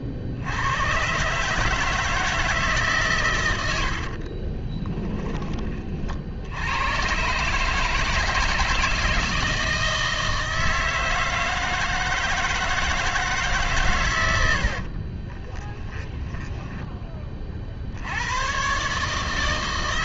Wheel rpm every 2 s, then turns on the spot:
80, 160, 30, 80, 170, 160, 160, 70, 10, 120.
4-6 16-18